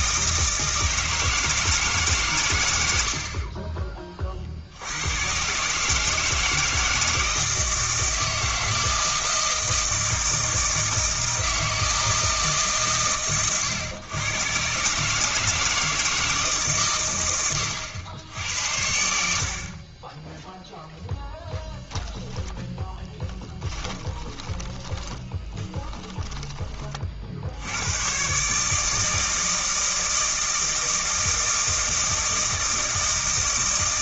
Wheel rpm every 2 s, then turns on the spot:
160, 90, 90, 160, 160, 160, 140, 130, 140, 80, 0, 10, 20, 30, 150, 160, 160.
22-26